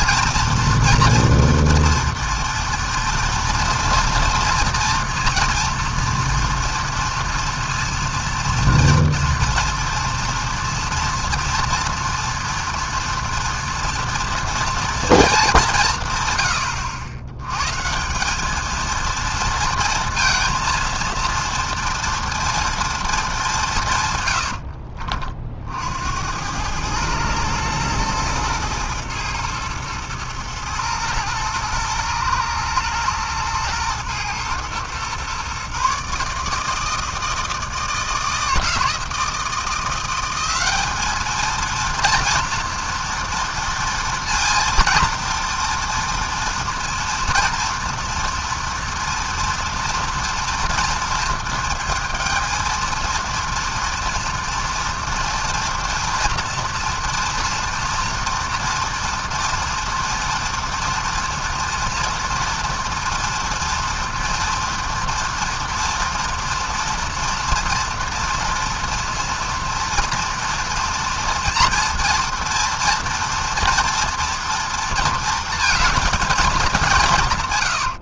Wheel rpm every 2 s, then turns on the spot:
230, 230, 230, 230, 240, 230, 230, 230, 110, 210, 230, 230, 100, 90, 110, 110, 110, 120, 150, 160, 190, 230, 230, 230, 230, 230, 220, 230, 230, 230, 230, 230, 230, 230, 240, 230, 230, 230, 210.
24-26